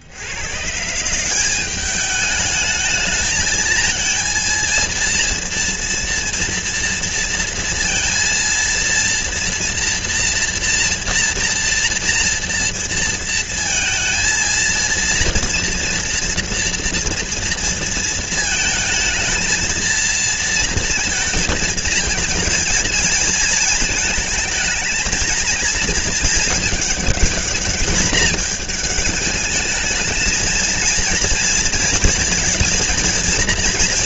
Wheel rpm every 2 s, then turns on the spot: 160, 210, 230, 230, 230, 230, 230, 230, 240, 220, 230, 220, 220, 210, 210, 230, 230.
none